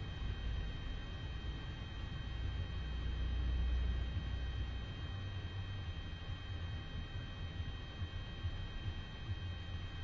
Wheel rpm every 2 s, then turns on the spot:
0, 0, 0, 0, 0.
none